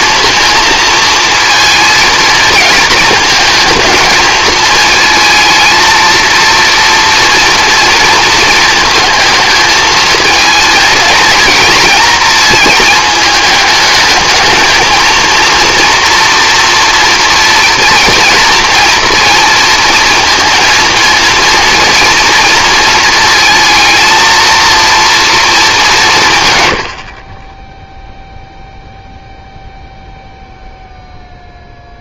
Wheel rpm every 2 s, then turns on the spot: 230, 220, 220, 230, 230, 220, 220, 220, 230, 230, 230, 230, 230, 120, 0, 0.
none